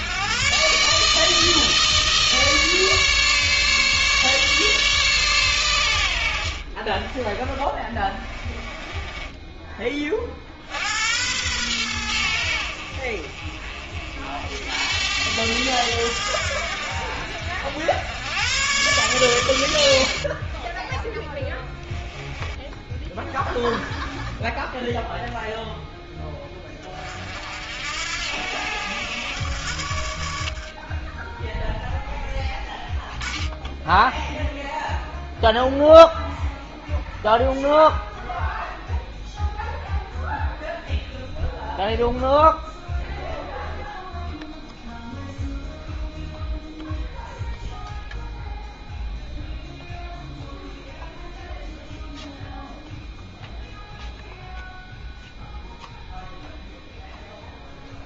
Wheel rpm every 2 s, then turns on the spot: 140, 150, 140, 60, 20, 50, 70, 70, 80, 110, 30, 20, 20, 20, 80, 40, 10, 0, 0, 0, 0, 0, 0, 0, 0, 0, 0, 0, 0.
6-10 20-22 32-34